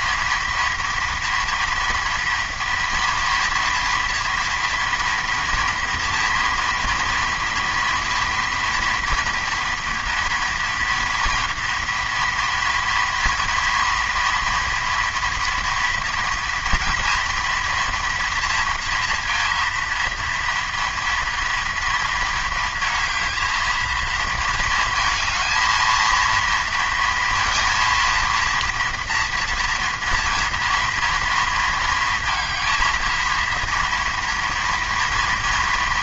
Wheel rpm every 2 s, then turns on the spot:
230, 230, 230, 230, 230, 230, 240, 230, 240, 230, 230, 230, 230, 230, 230, 230, 230, 240.
none